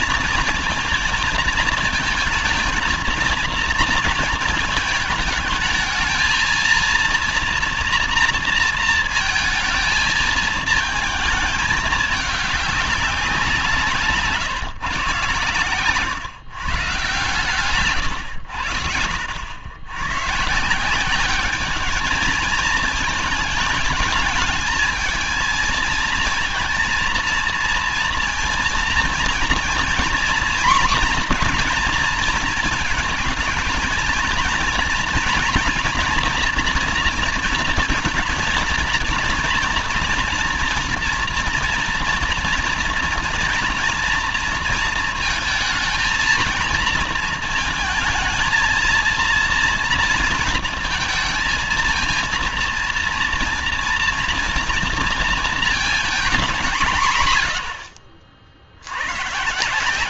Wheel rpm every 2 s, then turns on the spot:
230, 220, 220, 230, 230, 220, 200, 140, 130, 90, 150, 220, 210, 230, 230, 240, 230, 230, 230, 230, 230, 230, 230, 220, 220, 230, 230, 230, 180, 60.
none